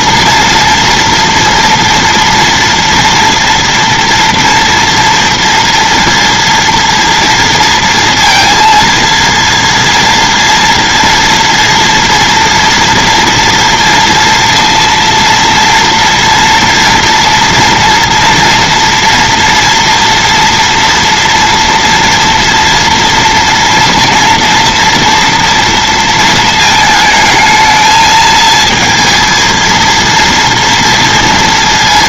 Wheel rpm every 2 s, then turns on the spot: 230, 230, 230, 230, 230, 230, 230, 230, 230, 240, 230, 230, 230, 220, 220, 230.
none